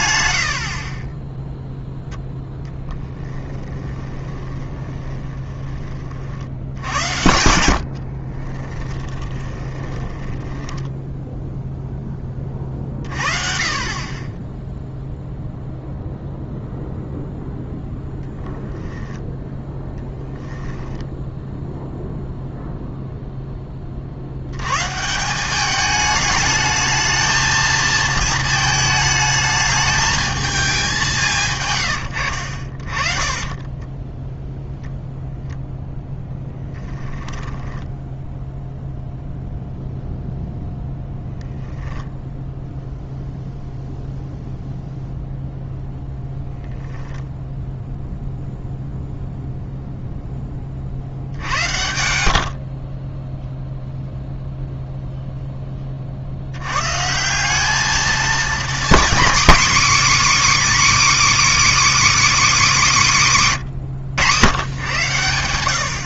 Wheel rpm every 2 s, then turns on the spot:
0, 20, 30, 50, 10, 0, 30, 0, 0, 10, 0, 30, 200, 220, 220, 130, 20, 0, 10, 0, 0, 0, 0, 0, 0, 80, 0, 0, 160, 250, 310, 220, 110.
2-4 6-10 18-20 32-34 36-38